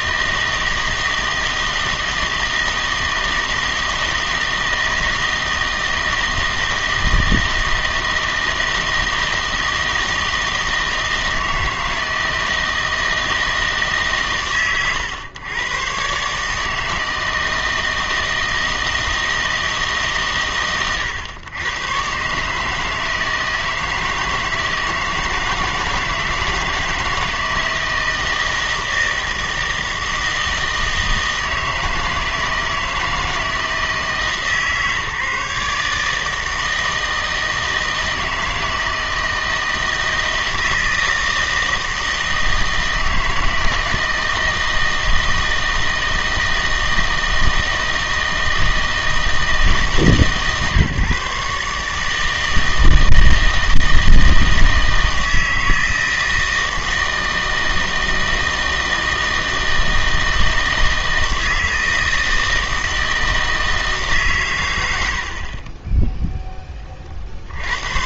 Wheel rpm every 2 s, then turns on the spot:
160, 160, 160, 160, 160, 160, 160, 120, 150, 160, 130, 150, 160, 160, 160, 160, 160, 150, 160, 160, 160, 160, 160, 160, 160, 140, 160, 160, 160, 160, 160, 160, 100, 10.
none